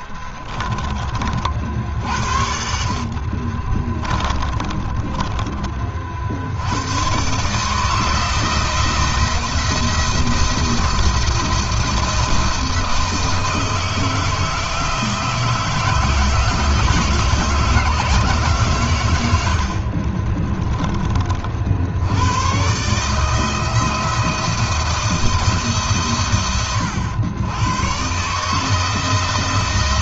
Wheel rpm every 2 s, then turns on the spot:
40, 50, 30, 110, 170, 170, 160, 160, 160, 120, 30, 150, 170, 100, 160.
2-6